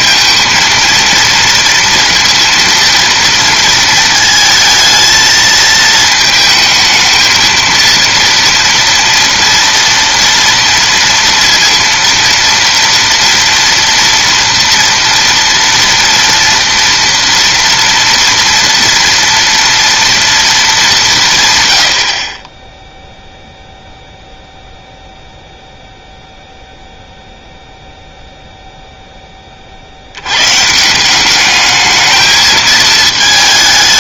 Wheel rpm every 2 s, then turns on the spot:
230, 230, 220, 220, 240, 230, 230, 230, 230, 230, 190, 10, 0, 0, 0, 150, 220.
none